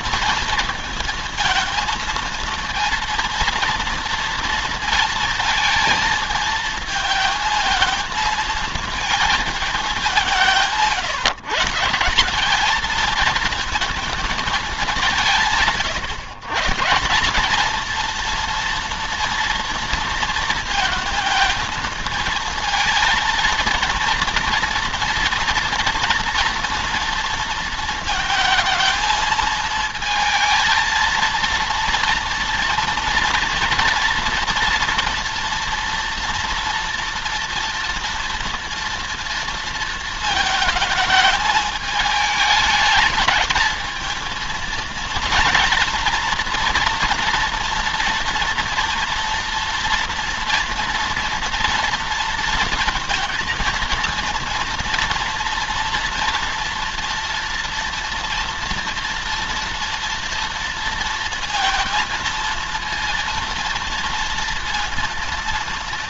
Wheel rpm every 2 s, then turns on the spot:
230, 230, 230, 220, 220, 170, 210, 200, 150, 230, 230, 230, 230, 230, 220, 230, 230, 230, 230, 230, 220, 210, 230, 240, 230, 230, 230, 240, 230, 230, 230, 230, 230.
none